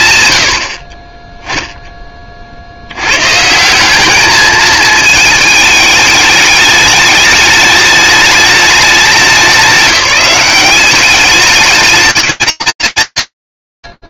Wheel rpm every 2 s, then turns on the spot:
10, 170, 210, 210, 190, 210, 160.
none